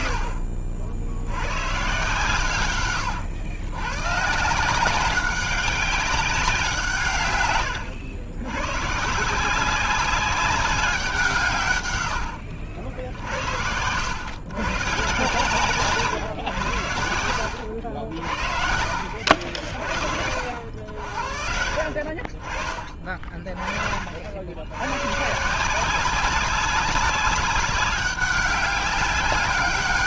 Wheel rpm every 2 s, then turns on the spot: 70, 120, 190, 150, 130, 190, 70, 120, 100, 70, 60, 40, 120, 190, 190.
2-4